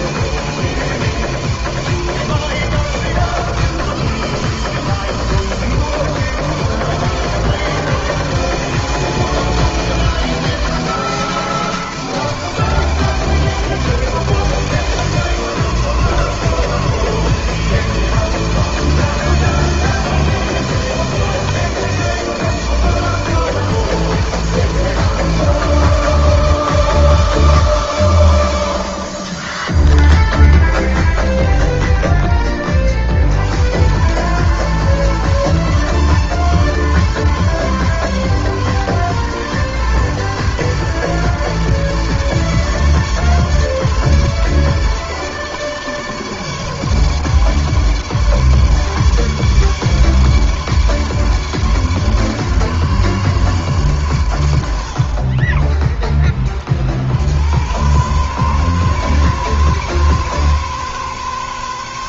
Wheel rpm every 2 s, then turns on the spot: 160, 160, 160, 160, 160, 160, 160, 160, 160, 160, 160, 160, 160, 160, 60, 30, 60, 140, 140, 140, 150, 140, 150, 150, 150, 150, 150, 50, 70, 130, 130.
28-32